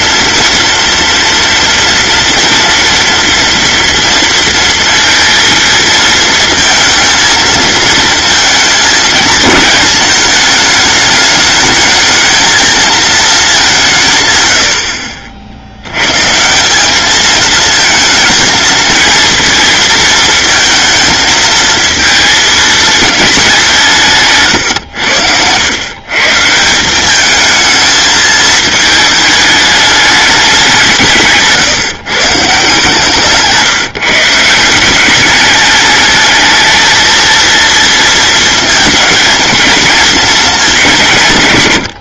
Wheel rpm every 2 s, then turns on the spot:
230, 230, 230, 230, 230, 220, 230, 70, 190, 220, 220, 220, 110, 180, 220, 180, 160, 180, 220, 230, 200.
none